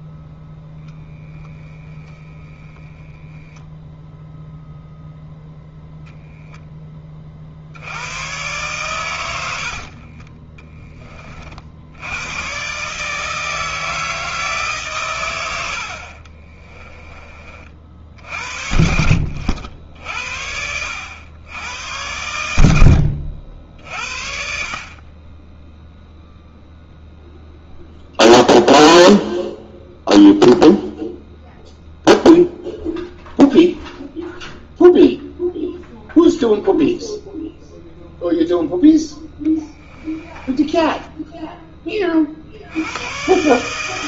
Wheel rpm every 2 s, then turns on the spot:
0, 10, 0, 10, 100, 30, 140, 140, 30, 60, 90, 80, 40, 0, 0, 0, 0, 0, 0, 0, 10, 90.
16-18 40-42